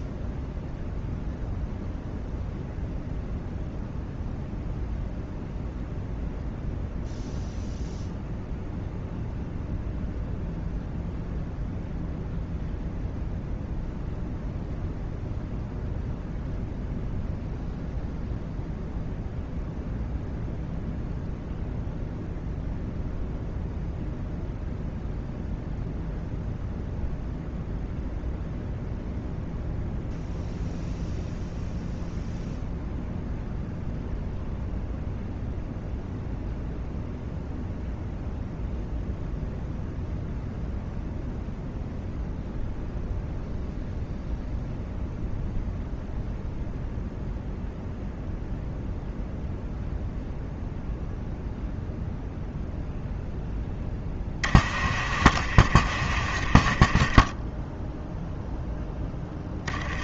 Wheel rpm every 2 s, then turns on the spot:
0, 0, 0, 0, 0, 0, 0, 0, 0, 0, 0, 0, 0, 0, 0, 0, 0, 0, 0, 0, 0, 0, 0, 0, 0, 0, 0, 40, 30, 0.
none